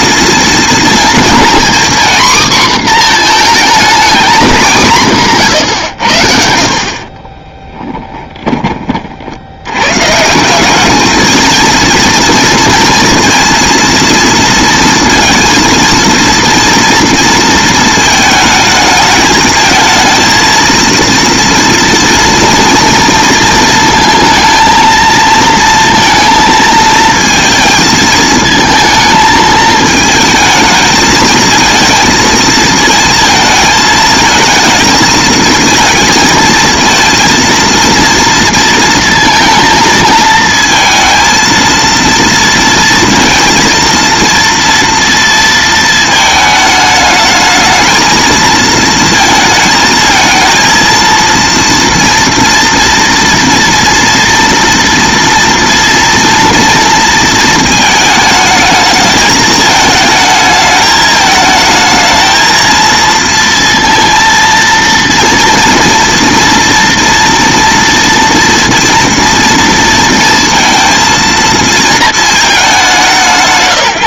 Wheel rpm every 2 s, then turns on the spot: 240, 220, 140, 10, 90, 230, 230, 230, 230, 220, 230, 230, 230, 230, 220, 230, 220, 220, 230, 230, 230, 230, 230, 220, 220, 230, 230, 230, 220, 220, 220, 230, 230, 230, 230, 230, 160.
4-8